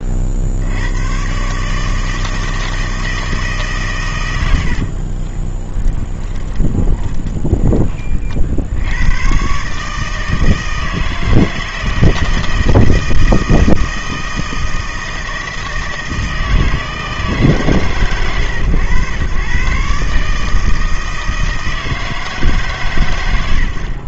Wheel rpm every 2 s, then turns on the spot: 80, 160, 70, 30, 70, 160, 160, 160, 160, 110, 160, 130.
4-8